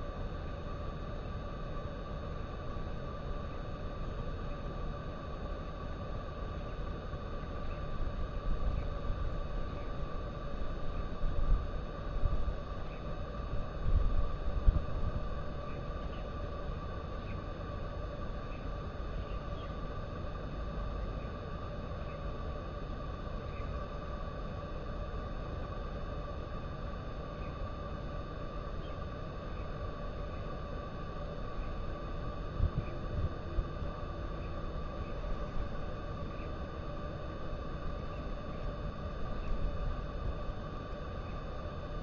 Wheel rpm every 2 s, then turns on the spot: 0, 0, 0, 0, 0, 0, 0, 0, 0, 0, 0, 0, 0, 0, 0, 0, 0, 0, 0, 0, 0.
none